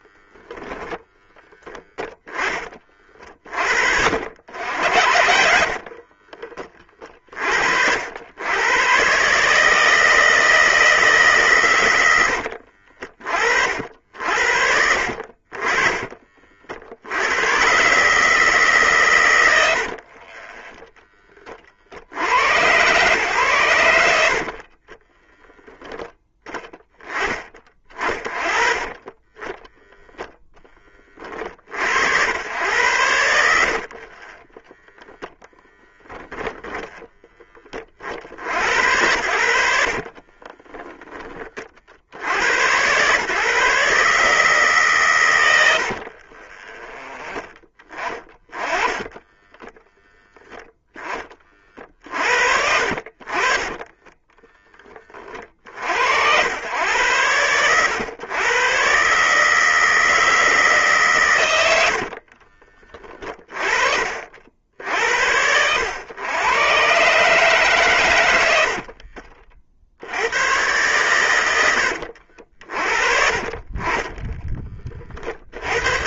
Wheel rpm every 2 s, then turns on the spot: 10, 40, 80, 30, 120, 160, 50, 70, 80, 130, 10, 120, 30, 10, 30, 30, 90, 10, 10, 80, 20, 120, 140, 20, 20, 10, 40, 20, 100, 130, 140, 30, 60, 120, 60, 110, 40, 30.
28-30 34-36 46-50 52-54 68-70